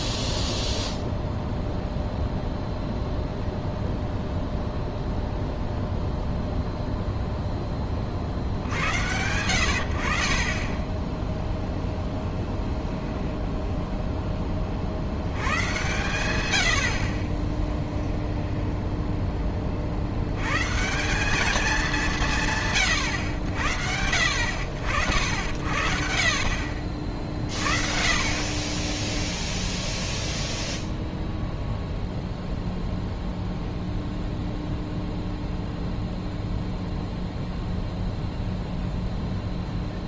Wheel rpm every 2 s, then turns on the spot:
0, 0, 0, 0, 80, 20, 0, 30, 80, 10, 130, 130, 70, 60, 30, 0, 0, 0, 0, 0.
18-20